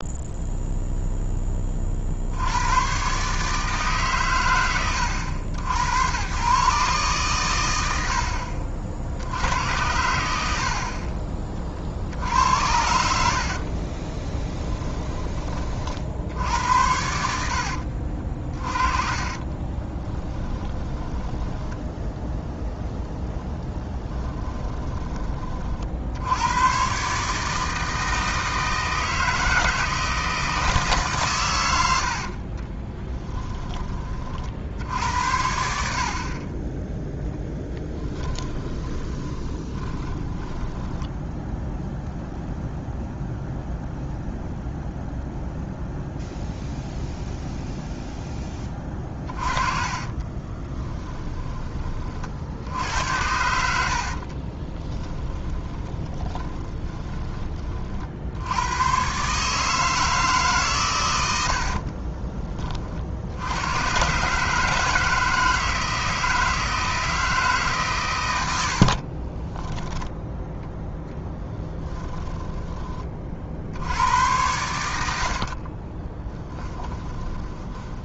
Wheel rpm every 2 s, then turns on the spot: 0, 90, 100, 130, 50, 70, 80, 20, 80, 40, 10, 0, 10, 100, 160, 160, 30, 60, 30, 20, 10, 0, 0, 0, 20, 20, 70, 30, 20, 90, 140, 30, 150, 160, 80, 10, 20, 90, 10.
14-16 20-22 32-34 38-42 48-52 54-58 72-74 76-78